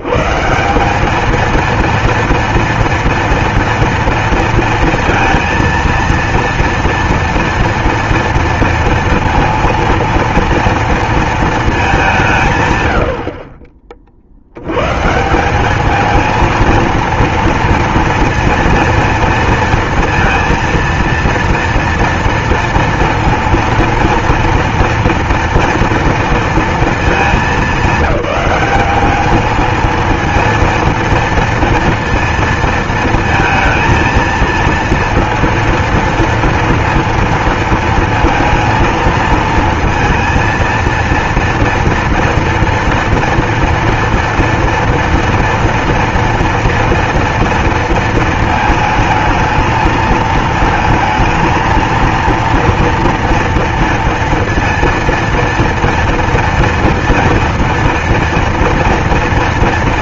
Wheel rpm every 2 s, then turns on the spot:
70, 230, 230, 230, 230, 230, 180, 60, 220, 230, 230, 230, 230, 230, 200, 230, 230, 230, 230, 230, 230, 230, 230, 230, 230, 220, 230, 230, 230, 230.
none